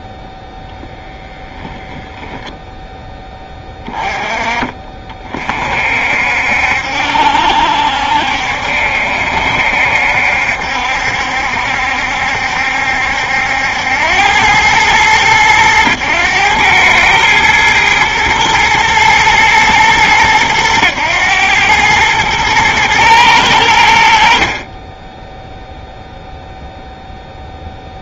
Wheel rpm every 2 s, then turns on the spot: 0, 0, 30, 60, 70, 70, 70, 100, 110, 110, 110, 110, 30, 0.
none